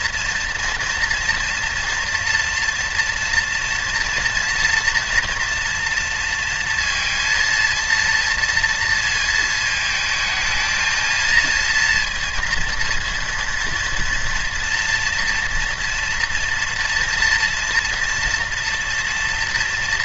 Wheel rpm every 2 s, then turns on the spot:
240, 240, 230, 230, 230, 230, 230, 230, 230, 230.
none